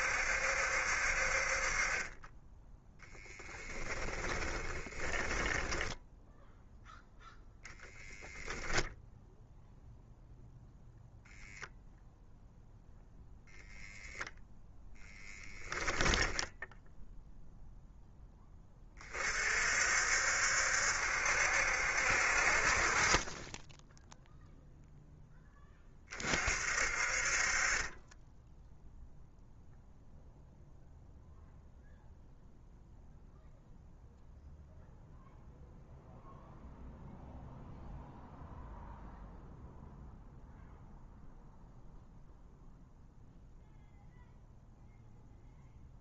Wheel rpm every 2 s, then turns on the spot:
60, 10, 10, 0, 0, 0, 0, 10, 0, 20, 70, 30, 0, 50, 0, 0, 0, 0, 0, 0, 0, 0, 0.
4-6 14-16